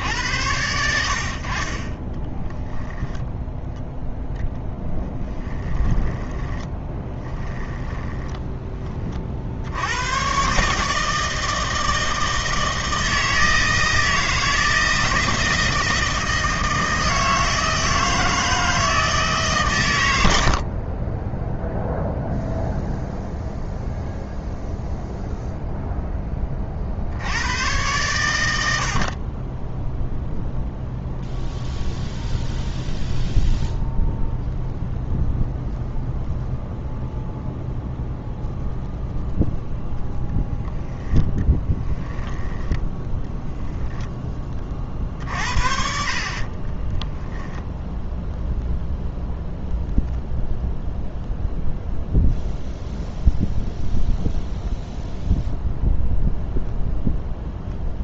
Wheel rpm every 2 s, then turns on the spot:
80, 10, 0, 10, 10, 140, 160, 160, 160, 160, 70, 0, 0, 30, 70, 0, 0, 0, 0, 0, 10, 10, 40, 20, 0, 0, 0, 0, 0.
2-4 6-8 20-22 42-44 46-48